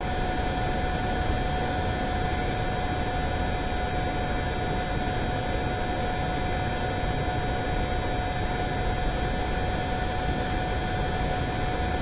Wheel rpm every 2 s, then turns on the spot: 0, 0, 0, 0, 0, 0.
none